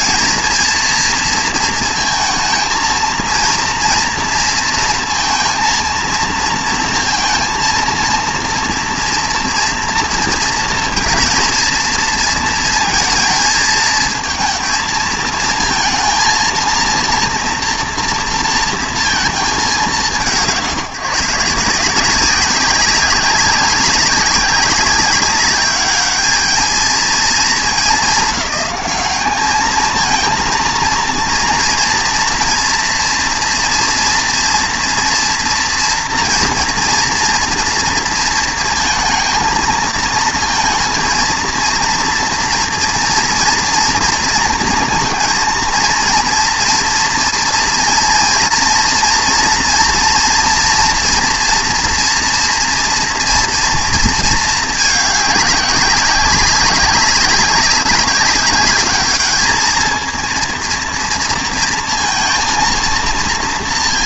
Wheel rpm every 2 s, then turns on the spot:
230, 230, 230, 230, 230, 230, 230, 230, 230, 230, 170, 190, 200, 220, 190, 230, 230, 240, 230, 230, 230, 230, 230, 230, 230, 240, 230, 210, 190, 210, 230, 230.
none